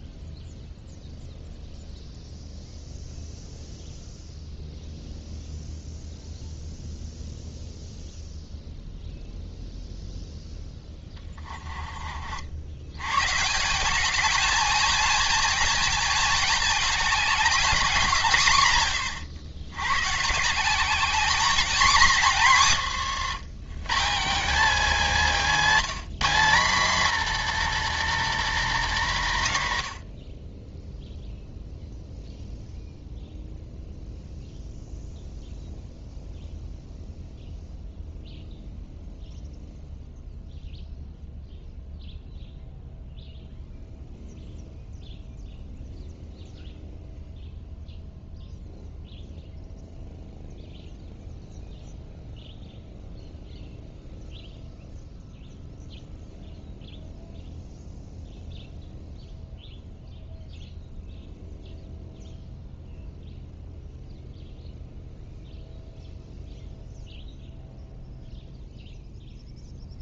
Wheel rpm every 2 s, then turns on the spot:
0, 0, 0, 0, 0, 10, 100, 220, 210, 110, 190, 160, 240, 230, 220, 10, 0, 0, 0, 0, 0, 0, 0, 0, 0, 0, 0, 0, 0, 0, 0, 0, 0, 0, 0.
10-12 22-24